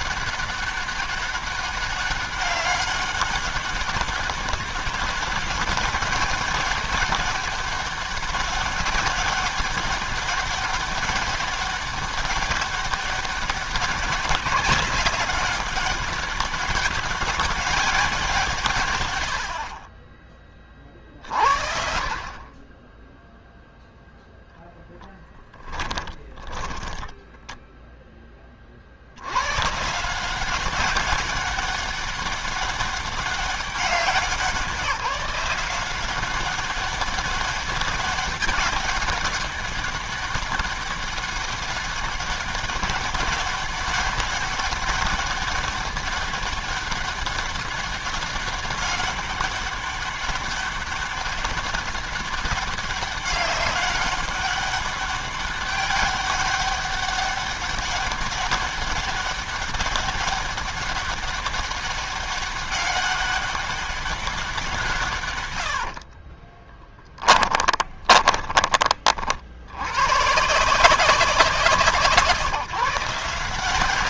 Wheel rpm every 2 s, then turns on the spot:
200, 190, 200, 200, 190, 200, 200, 200, 200, 100, 50, 0, 10, 10, 110, 200, 200, 170, 190, 200, 200, 200, 200, 200, 190, 200, 200, 200, 200, 200, 200, 200, 180, 20, 30, 160, 160.
24-28 66-68